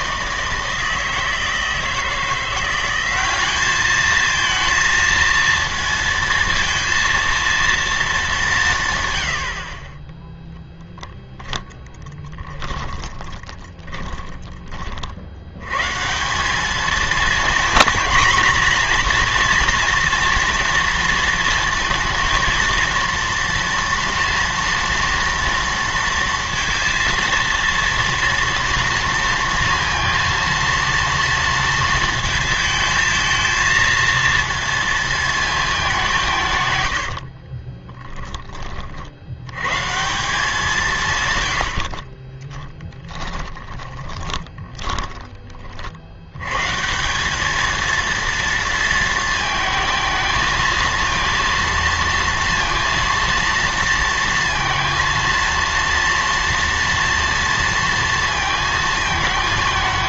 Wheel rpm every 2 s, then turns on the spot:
160, 180, 230, 230, 180, 0, 20, 30, 210, 240, 230, 230, 230, 230, 230, 230, 220, 230, 130, 40, 170, 10, 10, 140, 230, 230, 230, 230, 230, 230.
12-14 36-38 42-46